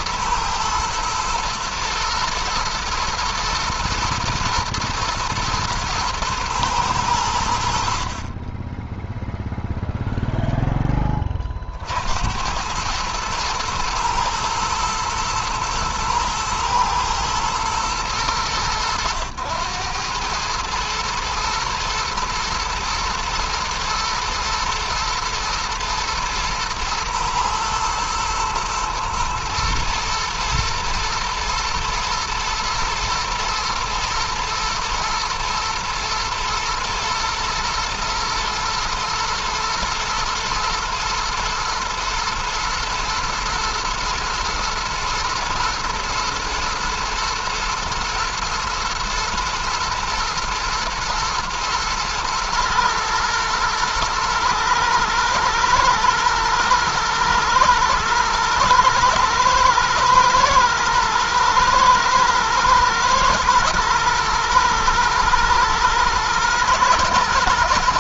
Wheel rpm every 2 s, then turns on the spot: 110, 110, 110, 90, 0, 20, 110, 110, 110, 100, 110, 110, 110, 110, 110, 110, 120, 110, 110, 110, 110, 110, 110, 110, 110, 110, 110, 110, 110, 110, 120, 110, 110, 110.
none